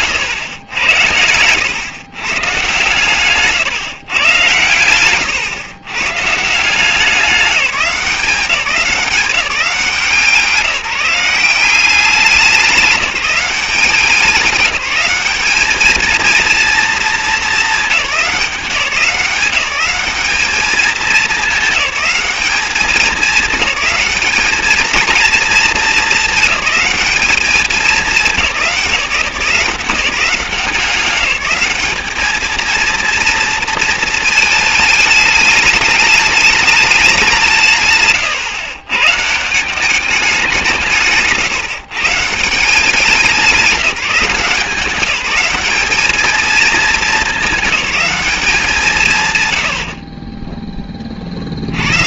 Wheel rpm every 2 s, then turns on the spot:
110, 140, 120, 160, 180, 170, 180, 200, 230, 190, 210, 200, 220, 210, 190, 180, 220, 220, 210, 130, 180, 160, 170, 220, 190, 20.
0-2 50-52